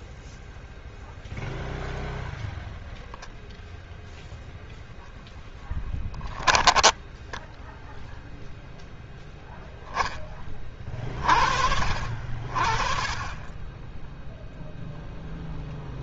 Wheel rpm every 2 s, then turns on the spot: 0, 0, 10, 20, 0, 30, 50, 0.
6-8